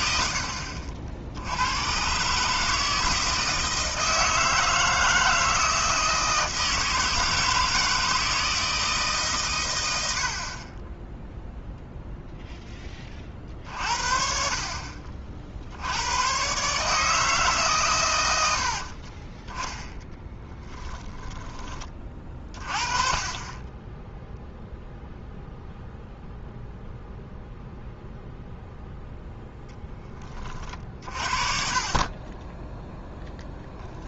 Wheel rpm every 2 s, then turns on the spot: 60, 160, 160, 160, 160, 20, 10, 40, 140, 60, 10, 30, 0, 0, 0, 40, 10.
18-22